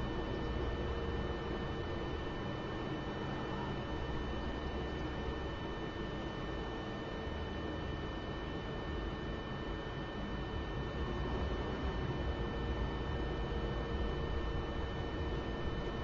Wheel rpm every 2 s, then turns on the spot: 0, 0, 0, 0, 0, 0, 0, 0.
none